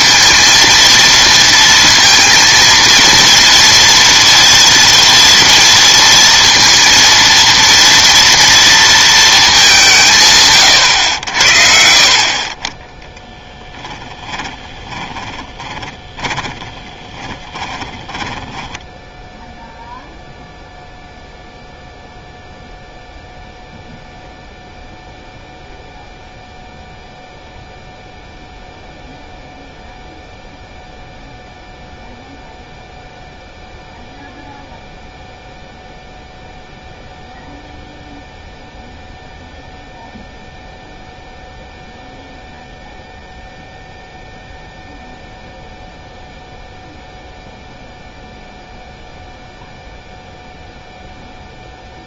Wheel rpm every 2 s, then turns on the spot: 230, 230, 230, 230, 230, 130, 20, 20, 20, 10, 0, 0, 0, 0, 0, 0, 0, 0, 0, 0, 0, 0, 0, 0, 0, 0.
14-20